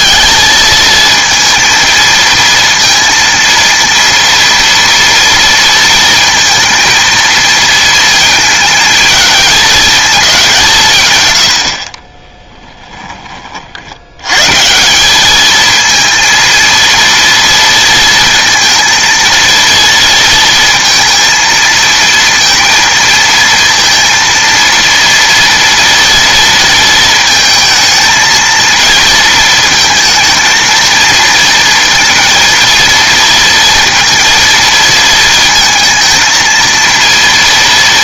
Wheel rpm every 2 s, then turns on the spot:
220, 230, 230, 230, 220, 170, 10, 160, 230, 230, 230, 230, 230, 230, 230, 230, 230, 230, 230.
none